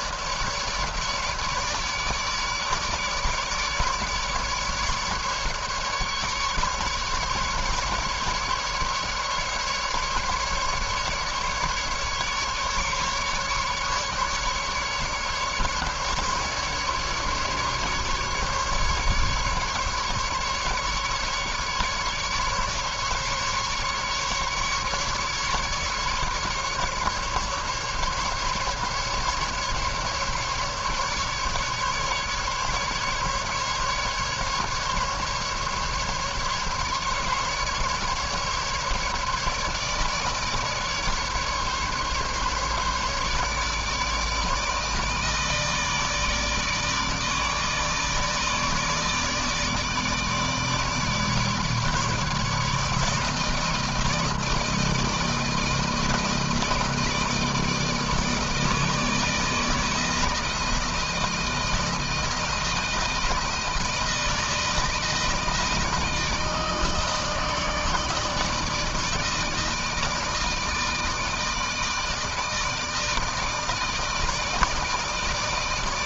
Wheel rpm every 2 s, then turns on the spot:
150, 150, 150, 150, 150, 150, 150, 150, 150, 140, 140, 140, 140, 140, 140, 150, 140, 140, 140, 150, 150, 140, 160, 150, 150, 150, 160, 160, 160, 160, 160, 160, 160, 160, 160, 160, 160, 160.
none